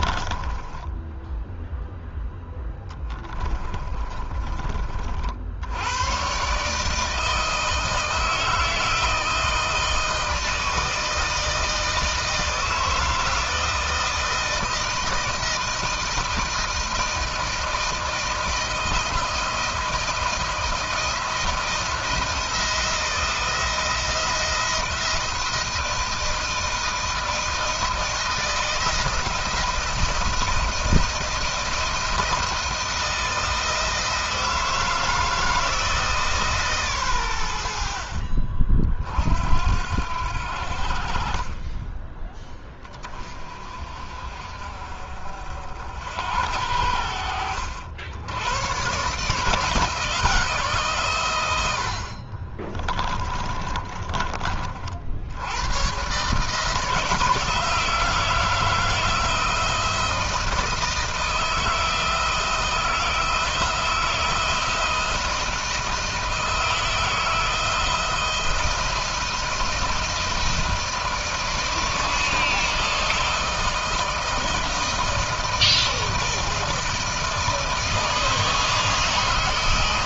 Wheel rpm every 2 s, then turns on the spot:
20, 10, 40, 150, 160, 160, 160, 160, 160, 160, 160, 170, 160, 160, 170, 160, 160, 160, 130, 50, 60, 20, 50, 80, 140, 140, 30, 50, 150, 160, 160, 160, 170, 160, 170, 160, 160, 160, 160, 160.
0-4 52-54